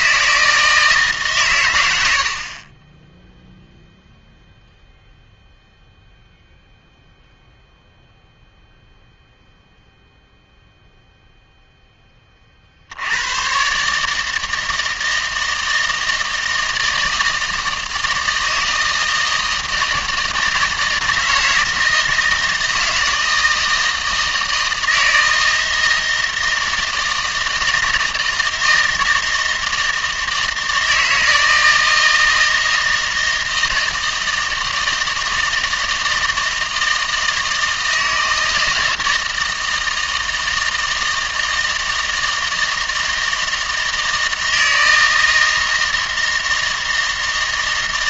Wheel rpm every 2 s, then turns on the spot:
160, 40, 0, 0, 0, 0, 60, 160, 160, 160, 160, 160, 160, 160, 160, 160, 160, 160, 160, 160, 160, 160, 160, 160.
none